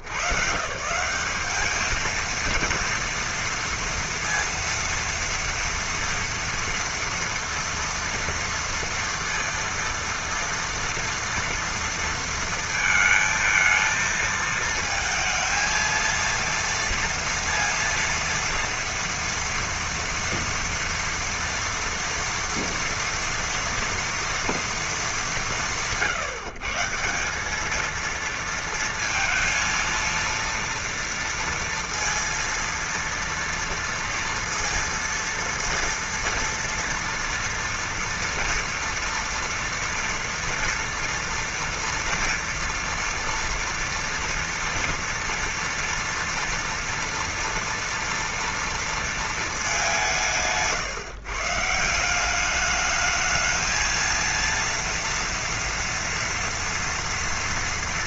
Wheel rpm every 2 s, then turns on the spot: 70, 220, 230, 230, 230, 230, 230, 220, 230, 230, 230, 230, 230, 160, 230, 230, 230, 230, 230, 230, 230, 240, 230, 230, 240, 160, 190, 230, 230.
none